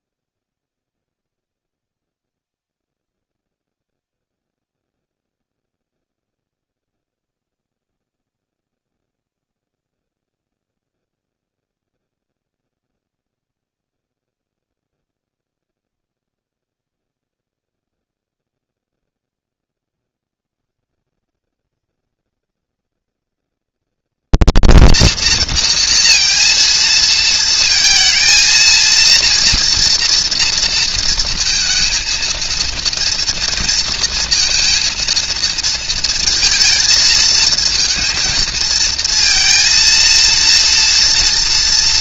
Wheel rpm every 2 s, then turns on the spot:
0, 0, 0, 0, 0, 0, 0, 0, 0, 0, 140, 230, 230, 230, 230, 230, 230, 230, 230, 230, 230.
none